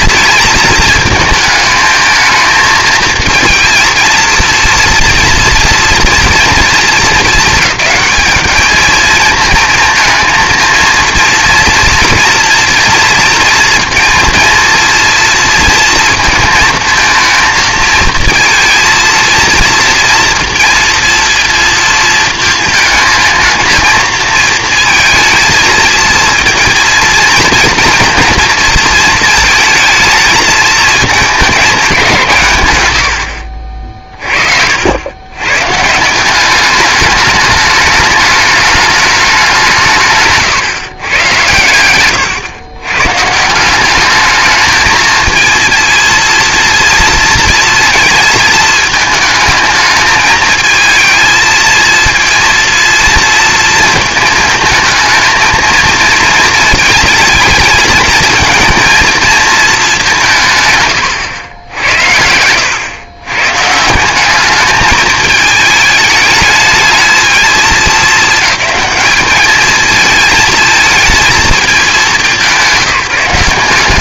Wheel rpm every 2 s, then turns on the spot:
220, 230, 230, 230, 220, 230, 240, 230, 230, 230, 230, 220, 230, 230, 220, 220, 120, 70, 200, 210, 120, 110, 220, 230, 220, 220, 230, 220, 220, 230, 120, 100, 210, 210, 210, 220, 170.
60-62